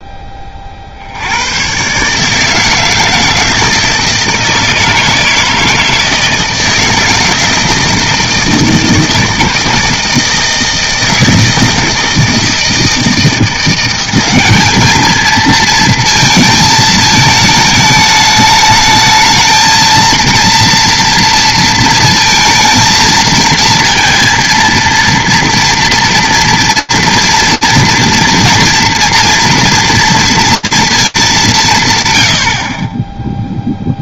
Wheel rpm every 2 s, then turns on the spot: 40, 160, 160, 160, 160, 160, 160, 200, 220, 210, 230, 230, 230, 230, 230, 220, 30.
none